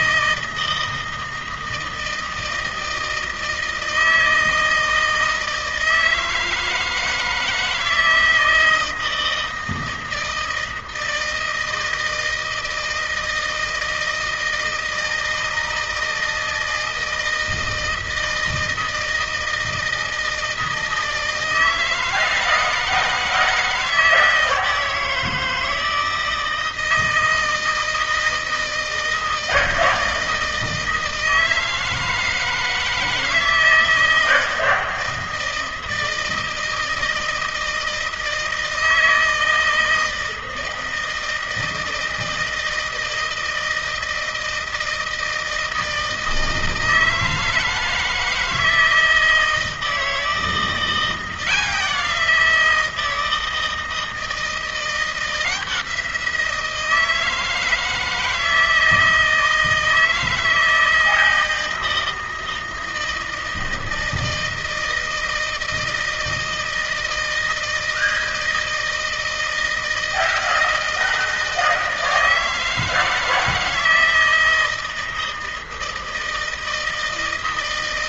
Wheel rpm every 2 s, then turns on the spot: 160, 160, 160, 160, 160, 160, 160, 160, 160, 160, 160, 160, 160, 160, 160, 160, 160, 160, 160, 160, 160, 160, 160, 160, 160, 170, 170, 170, 170, 160, 160, 160, 160, 160, 160, 160, 160, 160, 160.
none